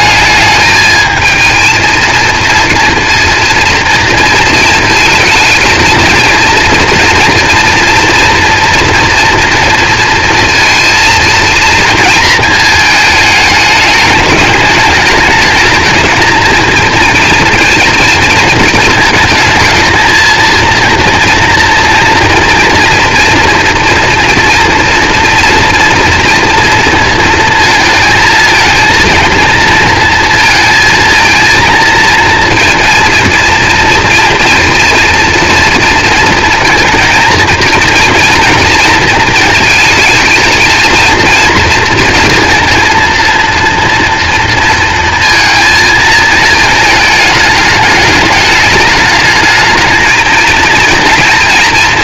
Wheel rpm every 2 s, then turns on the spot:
210, 230, 220, 230, 230, 230, 220, 210, 230, 230, 230, 230, 230, 230, 230, 230, 230, 230, 230, 230, 220, 230, 230, 220, 210, 230.
none